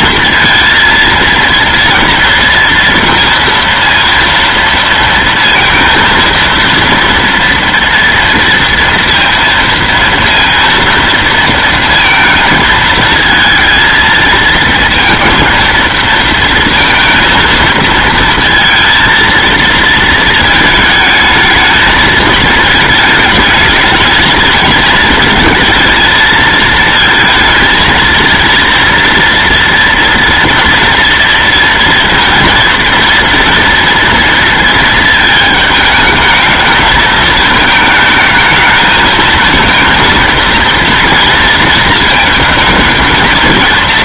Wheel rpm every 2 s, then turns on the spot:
230, 230, 230, 230, 230, 230, 230, 220, 230, 230, 220, 220, 220, 220, 230, 230, 230, 230, 220, 220, 230, 230.
none